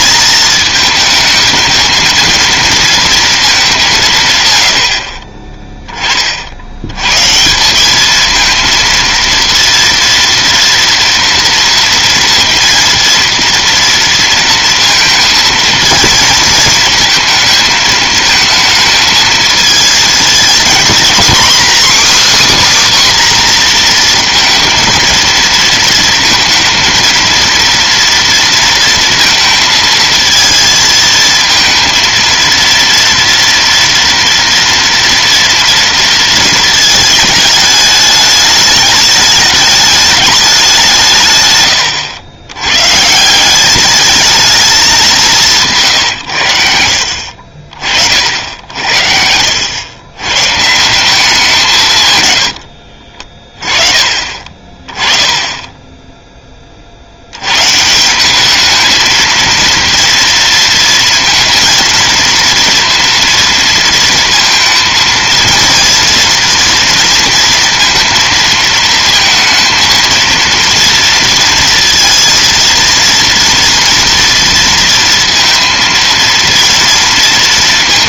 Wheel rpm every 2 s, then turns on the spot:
220, 230, 120, 50, 220, 230, 230, 230, 220, 220, 220, 290, 230, 230, 230, 230, 230, 230, 230, 210, 200, 90, 220, 100, 70, 130, 110, 30, 20, 200, 230, 230, 230, 230, 230, 230, 230, 230, 230.
none